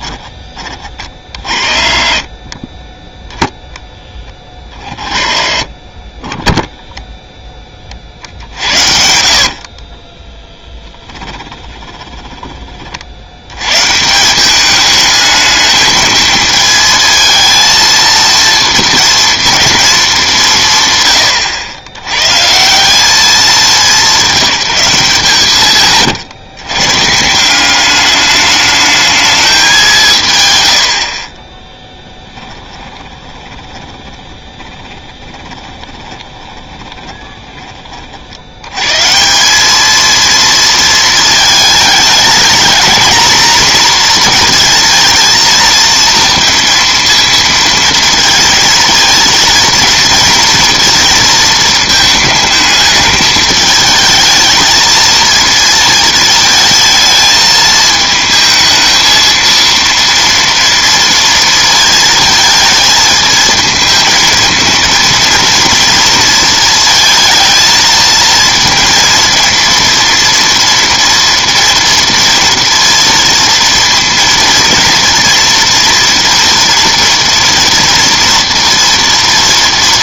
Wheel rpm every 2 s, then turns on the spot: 20, 20, 20, 10, 70, 10, 30, 200, 220, 230, 160, 170, 170, 120, 210, 90, 10, 20, 20, 110, 230, 220, 230, 230, 220, 230, 220, 220, 220, 220, 230, 220, 220, 220, 230, 230, 230, 230, 230, 230.
8-12 32-38